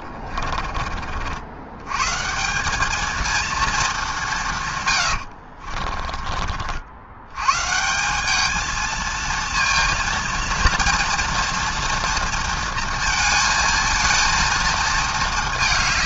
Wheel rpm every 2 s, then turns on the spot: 40, 200, 130, 70, 220, 230, 230, 230.
none